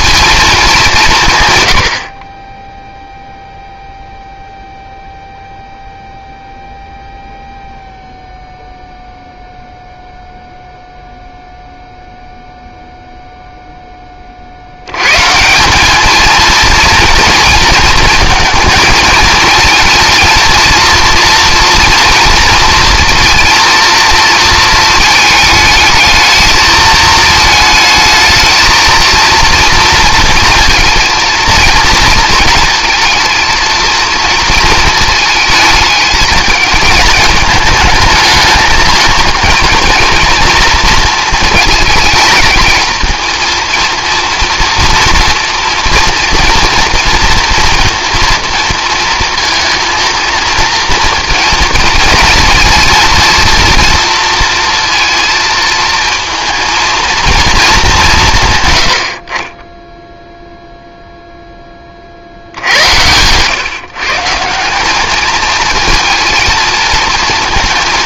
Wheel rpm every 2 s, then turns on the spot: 190, 0, 0, 0, 0, 0, 0, 70, 230, 220, 230, 230, 230, 220, 220, 230, 230, 230, 220, 220, 230, 220, 240, 230, 230, 230, 230, 230, 230, 130, 0, 70, 180, 230.
62-64